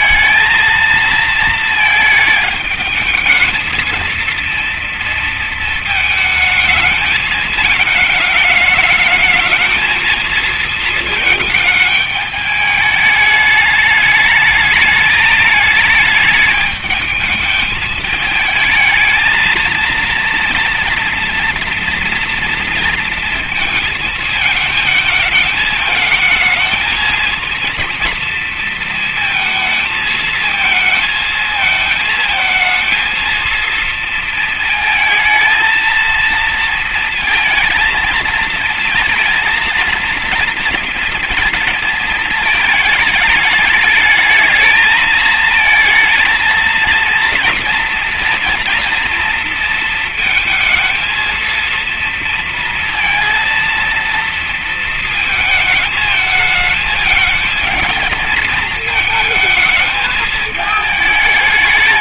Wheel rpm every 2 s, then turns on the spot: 220, 220, 230, 220, 210, 220, 210, 220, 220, 220, 230, 230, 220, 230, 230, 220, 220, 220, 230, 230, 230, 220, 220, 230, 230, 230, 230, 230, 210, 220, 190.
none